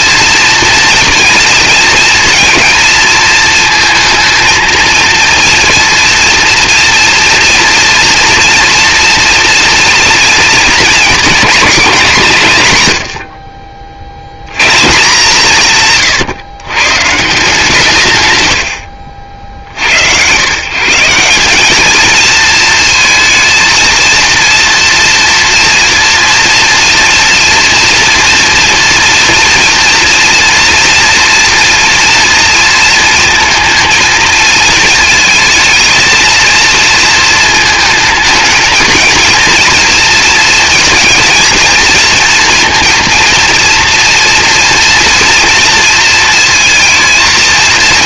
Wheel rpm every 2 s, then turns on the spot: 230, 230, 230, 230, 230, 220, 120, 140, 110, 100, 160, 230, 230, 230, 240, 240, 230, 230, 230, 220, 230, 230, 230, 230.
none